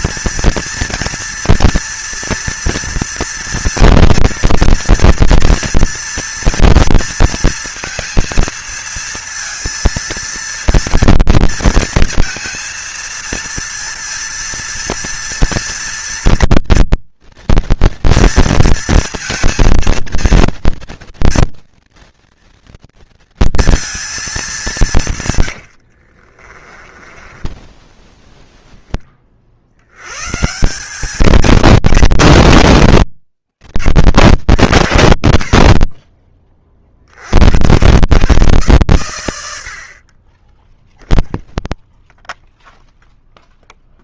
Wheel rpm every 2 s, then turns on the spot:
230, 230, 230, 230, 230, 230, 230, 230, 230, 230, 230, 230, 200, 30, 0, 150, 170, 120, 30, 130, 10, 0.
26-28